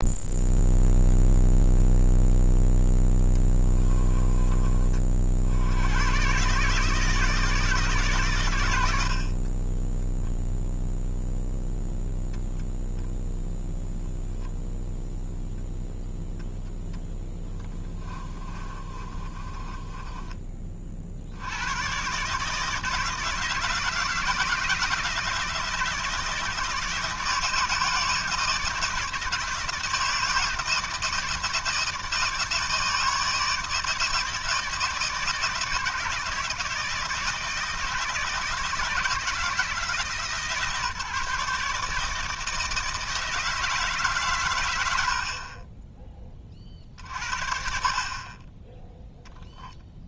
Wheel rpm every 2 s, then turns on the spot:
0, 10, 40, 150, 90, 0, 0, 0, 10, 30, 40, 160, 170, 160, 160, 160, 160, 160, 160, 160, 150, 160, 80, 50, 0.
2-4 18-20